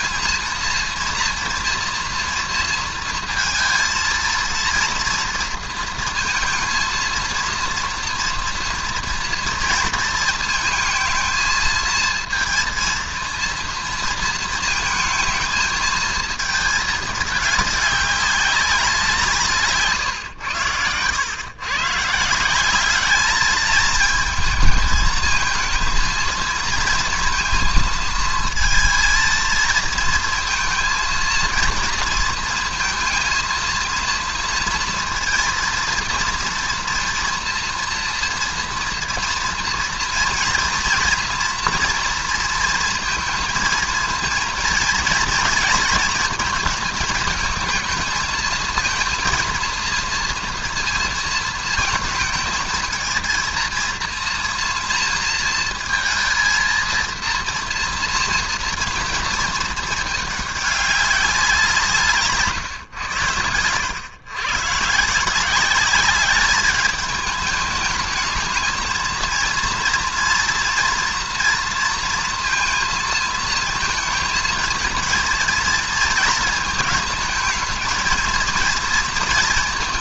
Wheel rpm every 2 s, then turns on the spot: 230, 230, 230, 230, 230, 220, 230, 220, 220, 200, 100, 180, 220, 230, 230, 230, 230, 230, 230, 230, 230, 230, 230, 220, 220, 230, 220, 230, 230, 230, 210, 130, 120, 200, 220, 230, 230, 230, 220, 230.
62-64